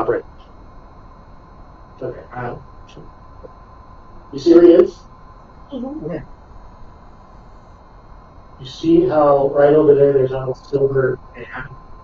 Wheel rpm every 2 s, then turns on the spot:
0, 0, 0, 0, 0, 0.
none